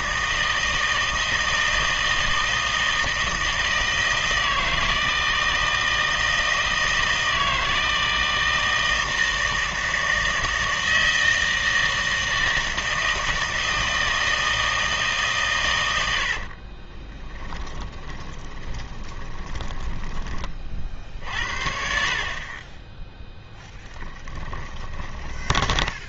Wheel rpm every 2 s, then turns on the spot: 160, 160, 160, 160, 160, 160, 160, 160, 40, 20, 30, 20, 20.
16-20 24-26